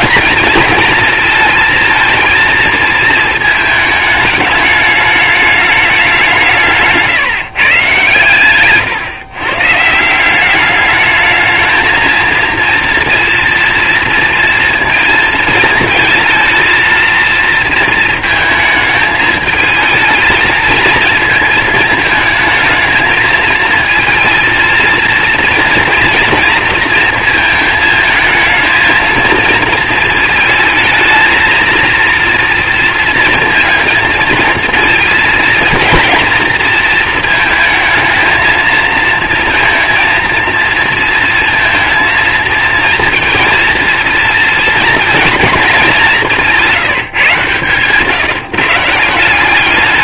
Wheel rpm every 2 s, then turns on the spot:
230, 220, 210, 150, 130, 210, 230, 230, 230, 220, 220, 220, 230, 230, 230, 220, 230, 230, 220, 230, 230, 230, 220, 150, 180.
none